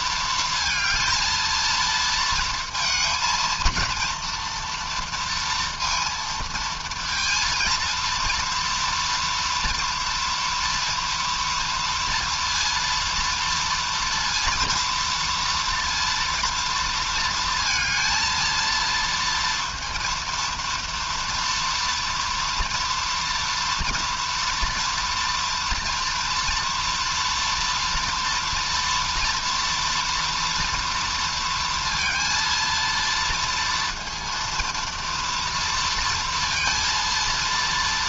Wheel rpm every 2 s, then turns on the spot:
230, 220, 230, 230, 230, 230, 230, 230, 230, 230, 230, 240, 240, 230, 230, 230, 230, 230, 230.
none